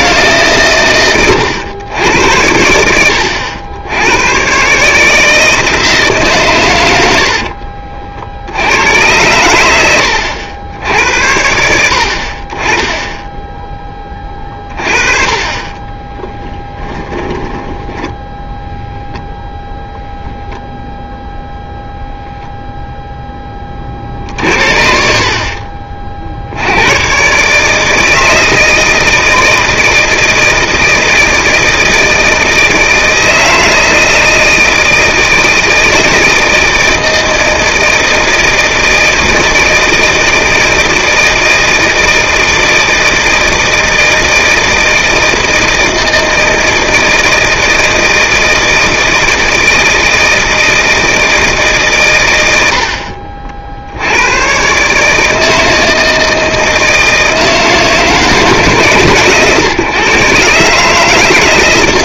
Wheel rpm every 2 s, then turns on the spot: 110, 80, 160, 50, 100, 80, 10, 30, 10, 0, 0, 0, 50, 100, 160, 160, 160, 160, 160, 160, 160, 160, 160, 160, 160, 160, 60, 130, 160, 150, 150.
6-8 16-18